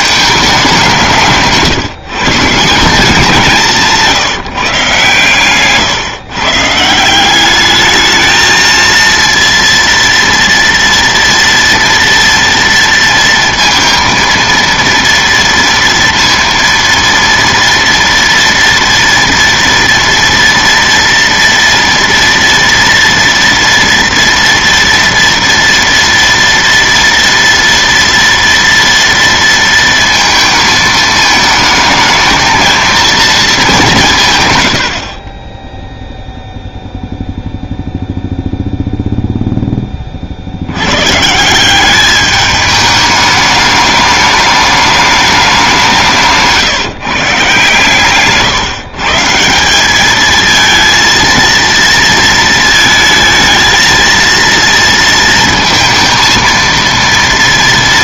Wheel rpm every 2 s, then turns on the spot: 200, 170, 140, 140, 230, 230, 230, 230, 230, 230, 230, 230, 240, 230, 230, 220, 220, 110, 0, 0, 70, 210, 210, 150, 140, 220, 220, 230, 230.
none